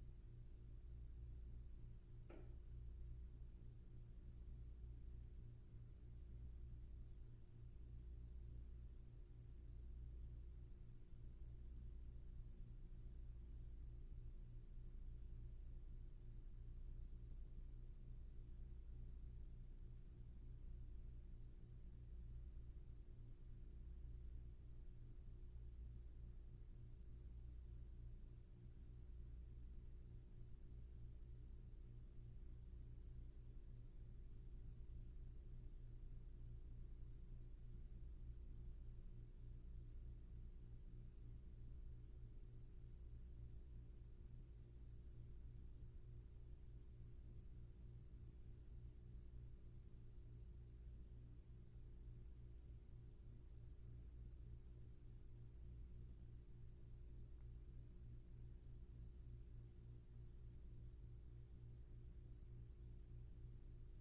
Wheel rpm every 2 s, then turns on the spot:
0, 0, 0, 0, 0, 0, 0, 0, 0, 0, 0, 0, 0, 0, 0, 0, 0, 0, 0, 0, 0, 0, 0, 0, 0, 0, 0, 0, 0, 0, 0, 0.
none